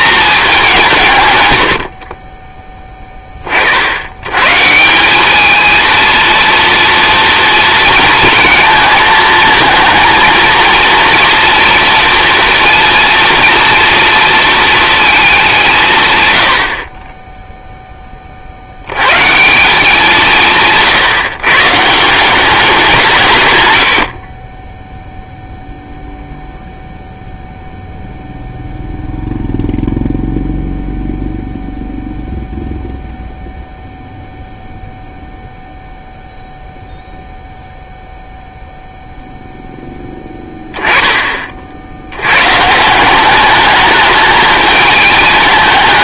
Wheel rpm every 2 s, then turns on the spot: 200, 20, 150, 230, 220, 230, 240, 230, 90, 40, 170, 180, 10, 0, 0, 0, 0, 0, 0, 0, 10, 140, 220.
none